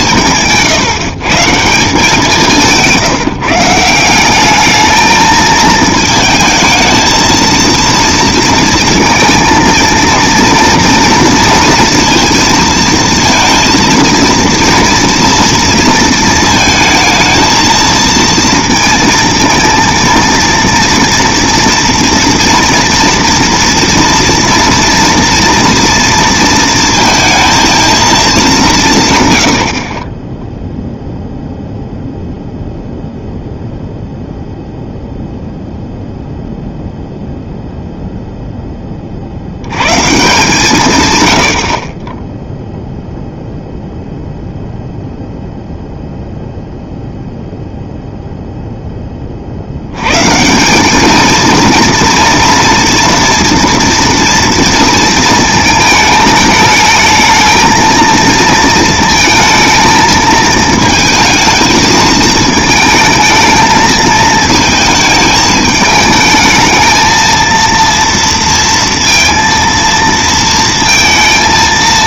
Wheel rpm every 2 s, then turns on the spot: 140, 170, 210, 220, 230, 230, 230, 230, 220, 230, 230, 240, 240, 230, 200, 0, 0, 0, 0, 0, 160, 0, 0, 0, 0, 180, 240, 230, 220, 230, 220, 220, 220, 220, 230, 230.
none